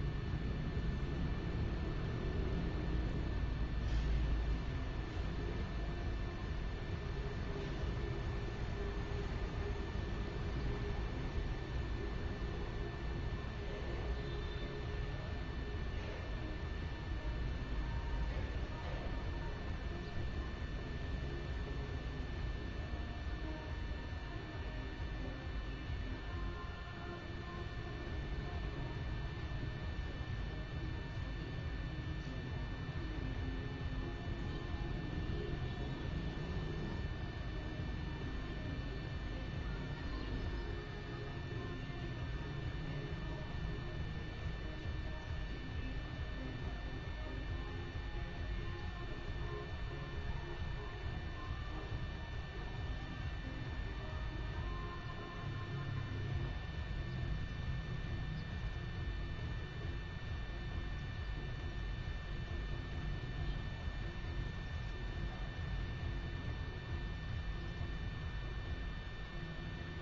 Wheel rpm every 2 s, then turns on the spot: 0, 0, 0, 0, 0, 0, 0, 0, 0, 0, 0, 0, 0, 0, 0, 0, 0, 0, 0, 0, 0, 0, 0, 0, 0, 0, 0, 0, 0, 0, 0, 0, 0, 0, 0.
none